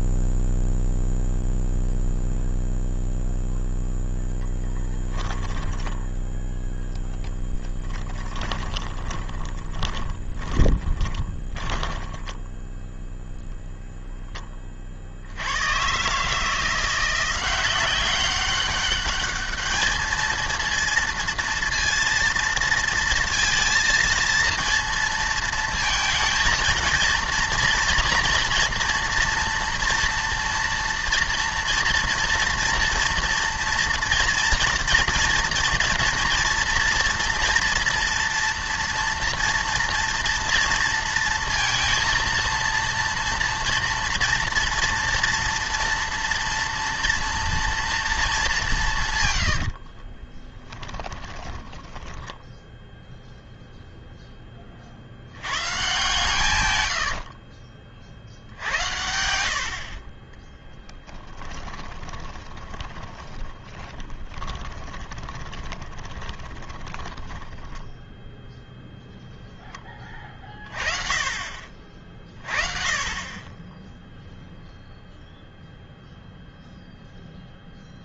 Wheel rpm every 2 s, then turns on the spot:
0, 0, 10, 10, 20, 20, 10, 30, 170, 200, 230, 230, 230, 230, 230, 230, 230, 230, 230, 230, 230, 230, 230, 230, 180, 10, 0, 30, 110, 80, 10, 20, 20, 20, 0, 30, 30, 0, 0.
4-6 8-14 50-52 56-58 60-68